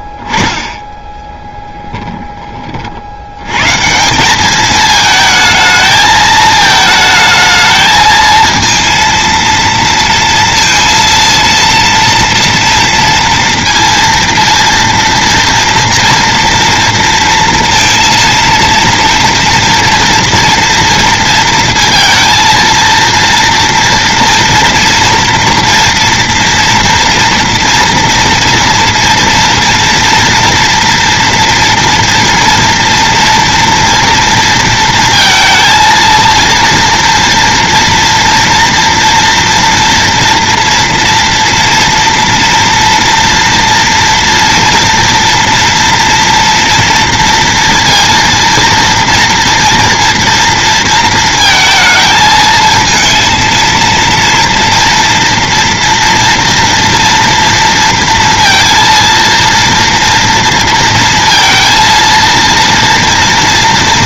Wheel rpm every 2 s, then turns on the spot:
20, 40, 210, 220, 230, 230, 230, 230, 230, 230, 230, 230, 230, 230, 230, 240, 230, 230, 240, 230, 230, 230, 230, 230, 230, 230, 220, 230, 230, 230, 230, 230.
none